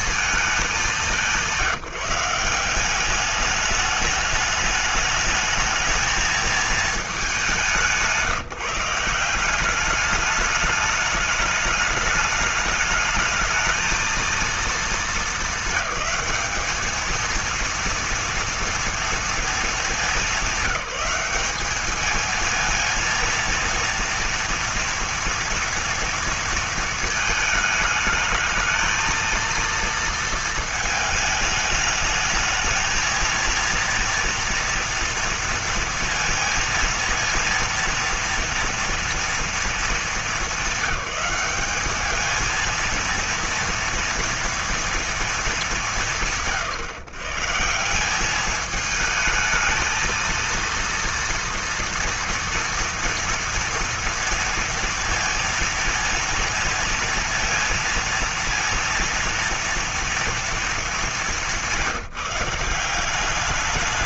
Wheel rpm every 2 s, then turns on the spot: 210, 190, 210, 220, 160, 210, 210, 220, 220, 230, 200, 230, 230, 230, 220, 220, 220, 230, 230, 230, 200, 230, 230, 120, 210, 230, 230, 230, 230, 230, 220, 180.
none